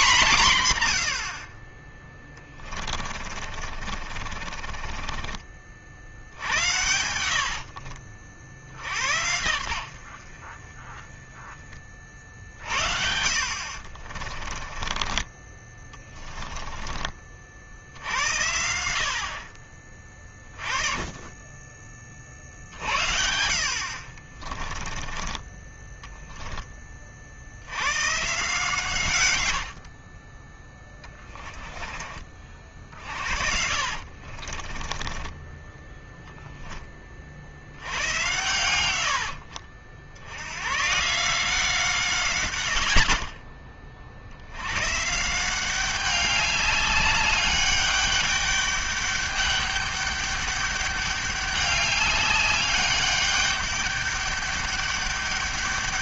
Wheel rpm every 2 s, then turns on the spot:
120, 30, 40, 70, 50, 30, 60, 20, 30, 70, 20, 60, 20, 30, 130, 20, 50, 40, 20, 90, 130, 90, 120, 200, 200, 200, 200, 200.
2-8 12-16 24-26 30-36 38-40